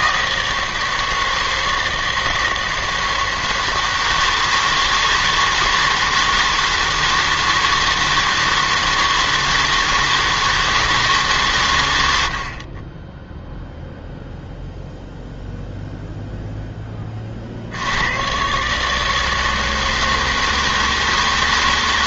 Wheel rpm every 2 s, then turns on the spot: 160, 160, 160, 160, 160, 160, 50, 0, 0, 130, 160.
none